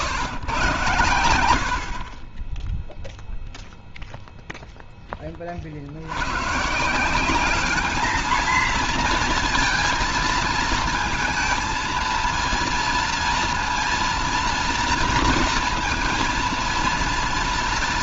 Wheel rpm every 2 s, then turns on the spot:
120, 10, 0, 110, 220, 230, 230, 230, 230.
none